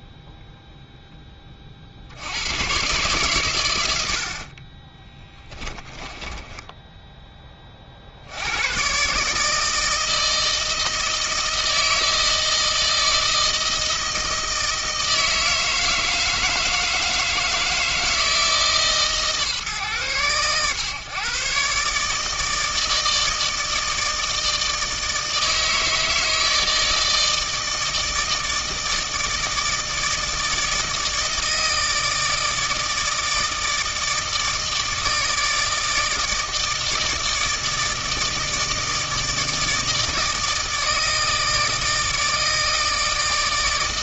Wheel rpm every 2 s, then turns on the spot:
0, 120, 20, 10, 120, 160, 160, 160, 160, 150, 120, 160, 160, 160, 160, 160, 160, 160, 160, 160, 160, 160.
4-8